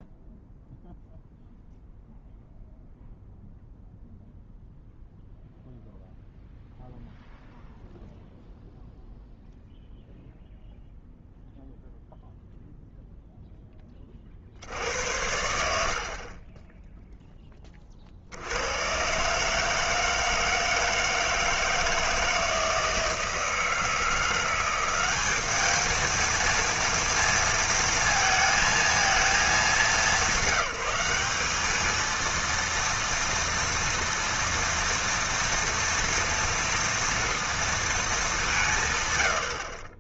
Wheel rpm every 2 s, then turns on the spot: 0, 0, 0, 0, 0, 0, 0, 60, 10, 90, 160, 160, 180, 230, 220, 180, 230, 230, 230, 170.
16-18